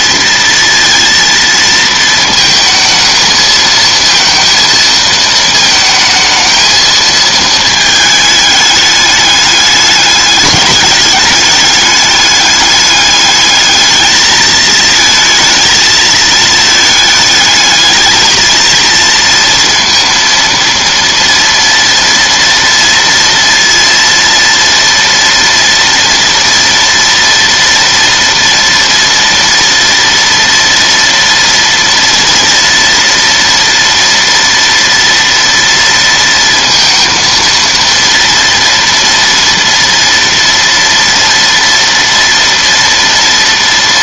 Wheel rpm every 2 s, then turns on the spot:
230, 220, 220, 220, 210, 210, 210, 220, 220, 230, 230, 230, 230, 230, 230, 230, 230, 230, 230, 230, 230, 230.
none